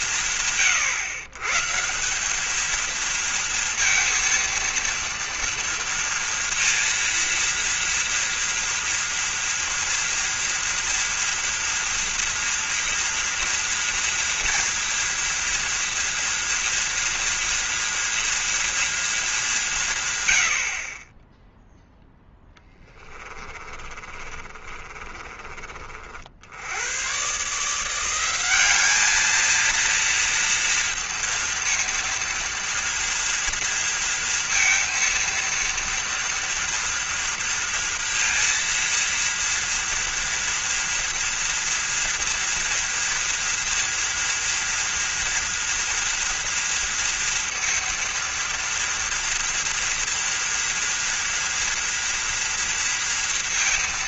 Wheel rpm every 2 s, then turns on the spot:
180, 220, 230, 230, 240, 230, 230, 230, 230, 230, 50, 10, 40, 90, 210, 230, 230, 230, 230, 230, 230, 230, 230, 230, 230, 230, 230.
22-26